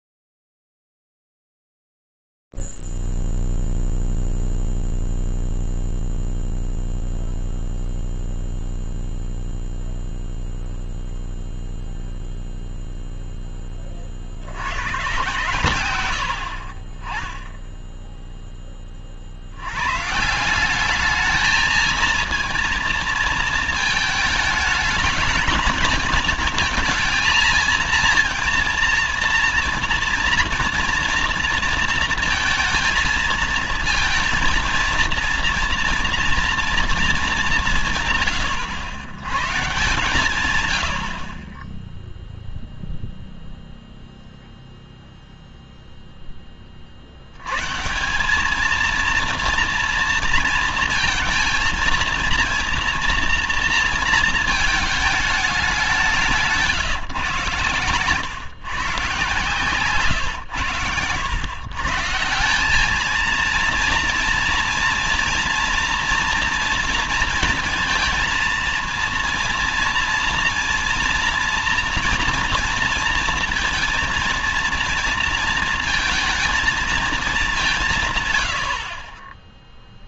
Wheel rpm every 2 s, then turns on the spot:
0, 0, 0, 0, 0, 0, 0, 40, 100, 10, 140, 230, 220, 220, 230, 230, 230, 230, 230, 130, 130, 0, 0, 30, 210, 230, 230, 220, 160, 130, 120, 170, 230, 230, 220, 230, 230, 230, 220, 80.
none